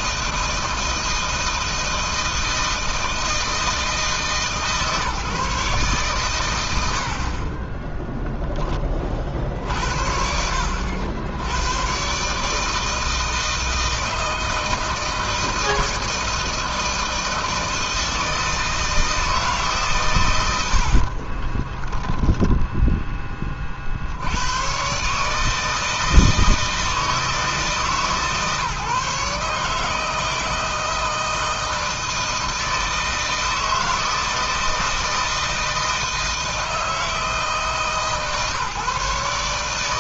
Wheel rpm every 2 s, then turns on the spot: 160, 160, 160, 110, 10, 80, 150, 160, 160, 160, 130, 10, 90, 160, 140, 160, 160, 160, 160, 150.
none